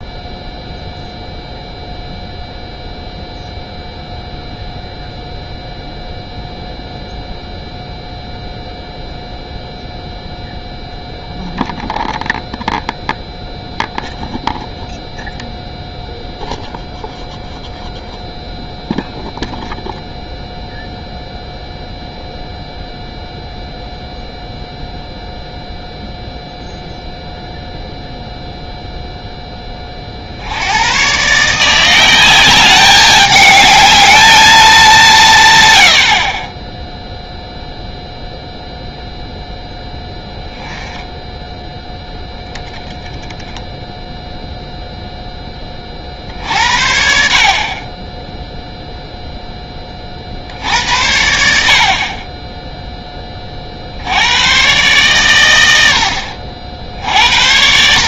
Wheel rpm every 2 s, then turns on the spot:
0, 0, 0, 0, 0, 0, 0, 0, 0, 0, 0, 0, 0, 0, 0, 100, 200, 190, 10, 0, 10, 10, 0, 60, 0, 60, 10, 110, 60.
none